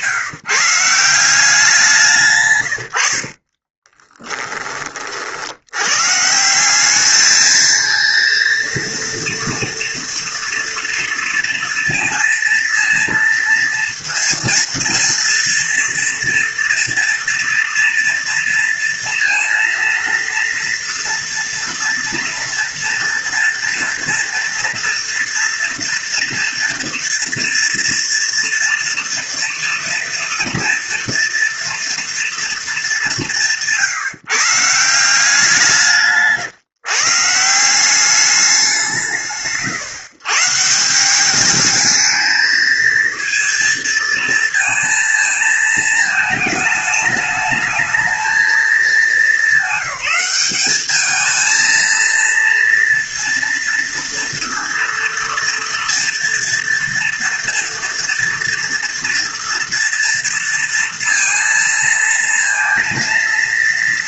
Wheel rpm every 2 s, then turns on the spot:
170, 70, 30, 200, 230, 230, 230, 230, 230, 230, 230, 230, 230, 230, 230, 230, 210, 170, 140, 170, 170, 230, 230, 220, 210, 210, 230, 230, 230, 230, 230, 230.
2-4